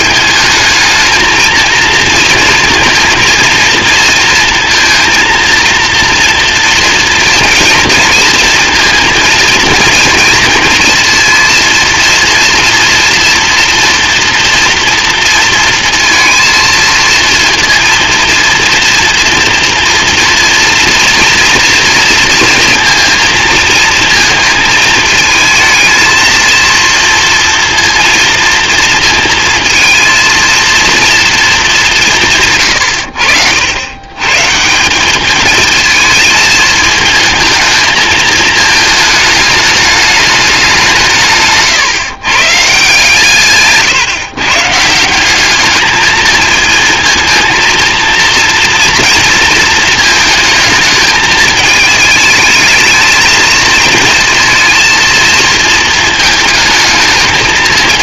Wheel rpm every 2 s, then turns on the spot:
210, 230, 230, 230, 230, 230, 230, 230, 230, 230, 230, 230, 220, 230, 230, 230, 120, 170, 220, 220, 180, 150, 160, 230, 230, 220, 220, 230, 220.
none